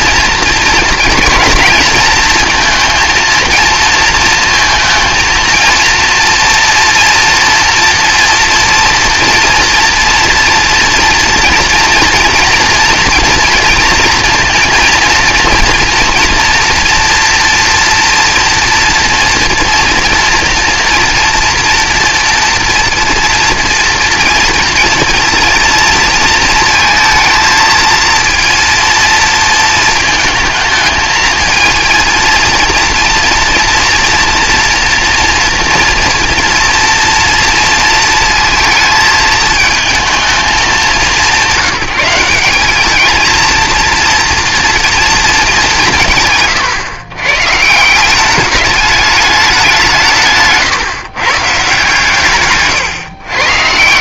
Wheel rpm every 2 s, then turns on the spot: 220, 220, 230, 240, 230, 230, 230, 230, 230, 230, 230, 230, 230, 220, 230, 220, 230, 230, 230, 220, 180, 200, 230, 120, 200, 140, 140.
none